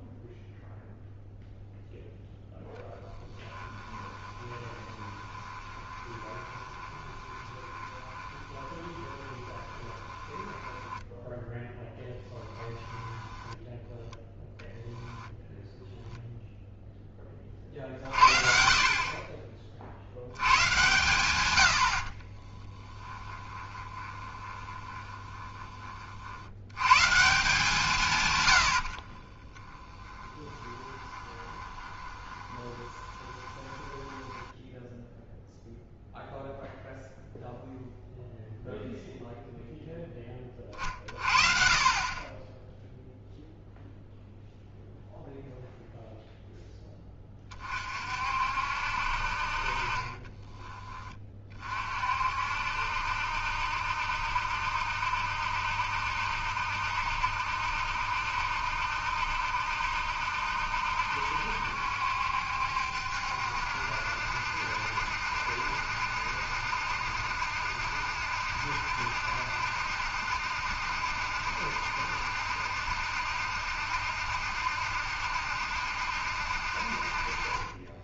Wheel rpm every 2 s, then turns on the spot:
0, 0, 20, 20, 20, 10, 20, 0, 0, 50, 120, 10, 20, 90, 80, 20, 20, 10, 0, 0, 30, 10, 0, 10, 60, 20, 60, 70, 70, 70, 70, 70, 70, 70, 70, 70, 70, 70, 60.
4-14 22-26 28-36